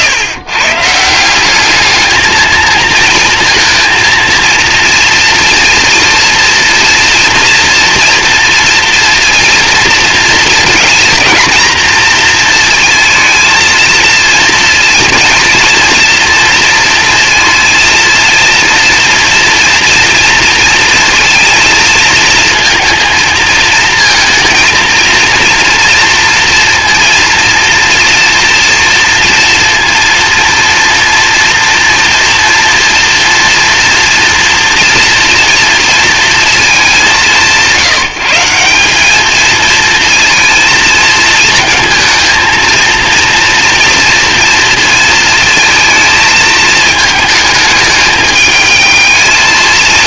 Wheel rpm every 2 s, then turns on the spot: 150, 220, 230, 230, 230, 220, 230, 230, 230, 230, 230, 230, 230, 230, 230, 230, 230, 230, 230, 170, 220, 230, 230, 220, 210.
none